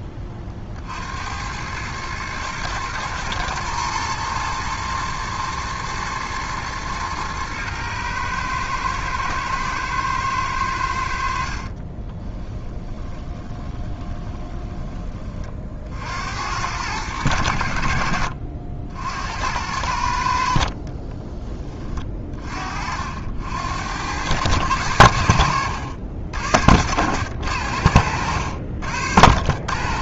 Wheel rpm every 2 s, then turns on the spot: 30, 110, 110, 110, 110, 100, 20, 20, 90, 70, 50, 40, 100, 80, 70.
12-16 20-22